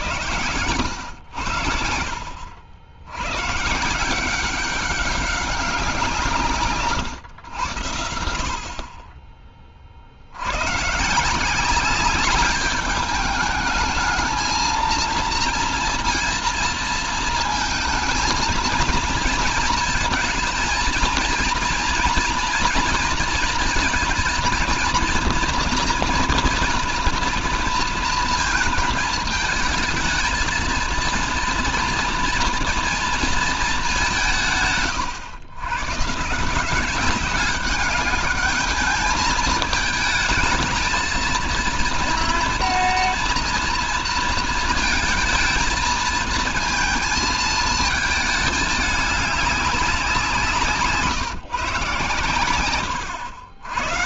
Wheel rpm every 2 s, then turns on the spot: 90, 70, 190, 140, 40, 100, 200, 230, 230, 230, 220, 230, 230, 230, 220, 220, 230, 140, 170, 210, 220, 230, 220, 220, 210, 160, 130.
none